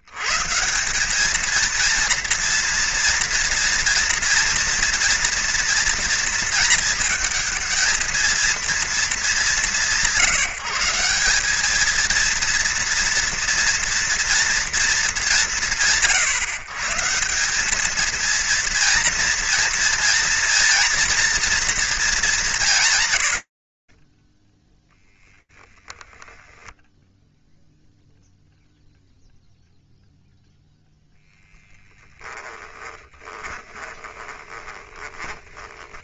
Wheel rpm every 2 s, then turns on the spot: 110, 230, 230, 230, 220, 160, 230, 240, 130, 230, 240, 200, 10, 10, 0, 0, 20, 20.
32-36